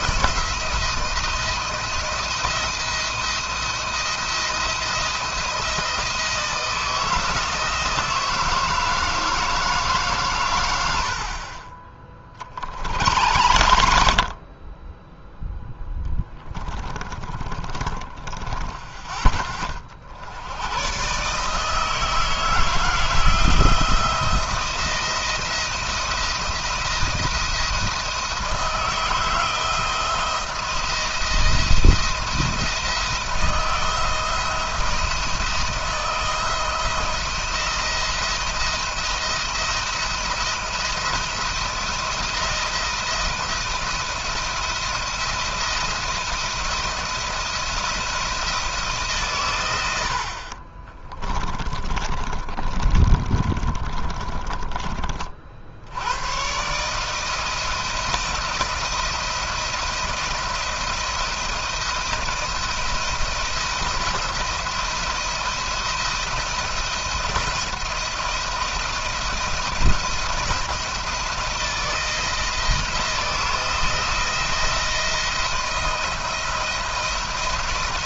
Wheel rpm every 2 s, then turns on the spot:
170, 170, 170, 160, 160, 80, 60, 20, 30, 20, 120, 160, 170, 170, 160, 160, 170, 160, 170, 170, 170, 170, 170, 170, 150, 20, 20, 30, 140, 170, 170, 170, 170, 170, 170, 170, 160, 170, 160.
16-18 50-54